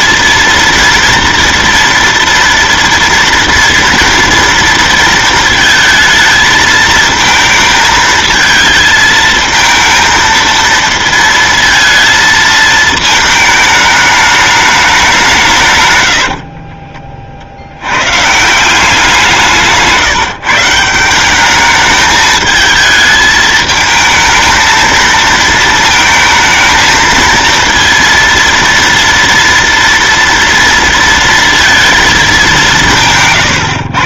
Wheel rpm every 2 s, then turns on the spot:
230, 230, 230, 220, 220, 230, 220, 210, 60, 160, 150, 220, 220, 220, 230, 230, 190.
16-18